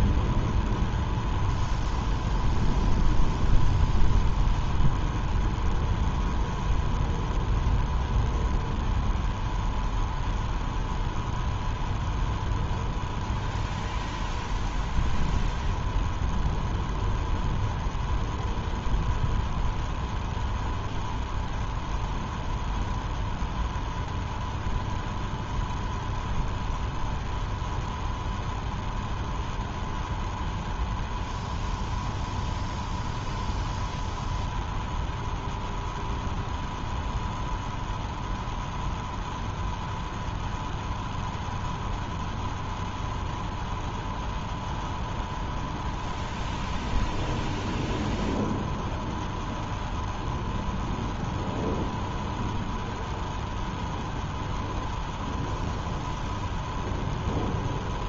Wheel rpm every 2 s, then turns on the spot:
0, 0, 0, 0, 0, 0, 0, 0, 0, 0, 0, 0, 0, 0, 0, 0, 0, 0, 0, 0, 0, 0, 0, 0, 0, 0, 0, 0, 0.
none